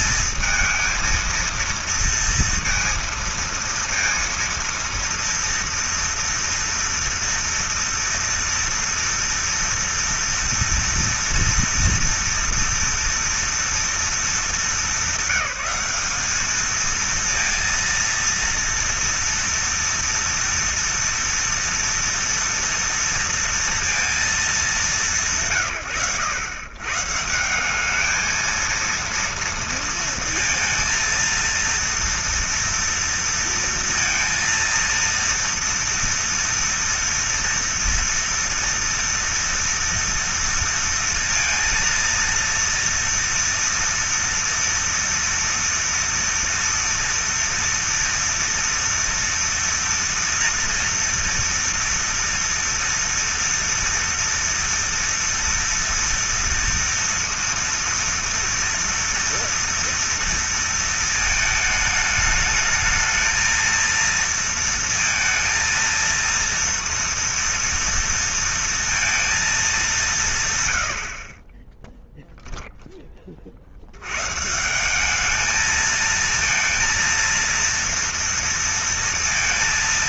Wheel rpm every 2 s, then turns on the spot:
220, 230, 230, 230, 230, 230, 230, 210, 220, 230, 230, 230, 210, 120, 230, 230, 230, 230, 240, 230, 230, 230, 230, 230, 240, 230, 230, 230, 230, 230, 230, 210, 230, 230, 230, 120, 0, 170, 230, 230.
none